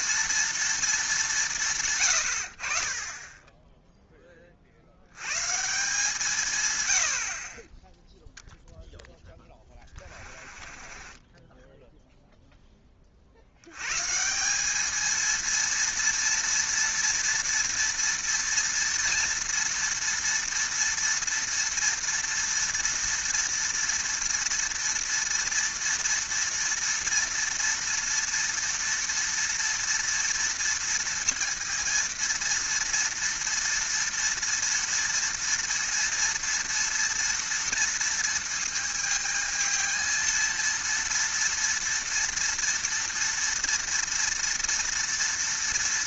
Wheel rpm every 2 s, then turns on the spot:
230, 70, 40, 130, 0, 30, 10, 200, 230, 230, 230, 230, 230, 230, 230, 230, 230, 230, 230, 230, 230, 230, 230.
10-12